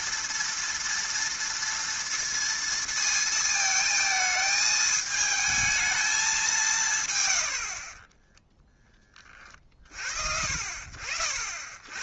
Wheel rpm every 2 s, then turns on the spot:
230, 230, 220, 180, 10, 60.
none